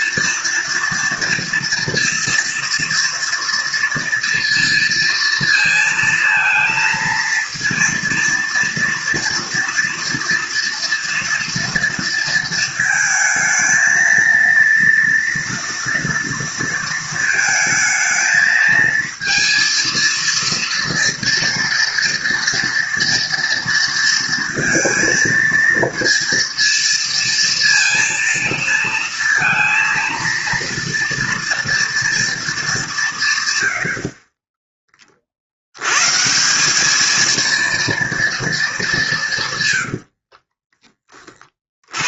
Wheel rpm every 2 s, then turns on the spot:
240, 240, 230, 230, 230, 230, 230, 230, 230, 220, 230, 230, 230, 230, 230, 230, 230, 50, 140, 230, 70.
40-42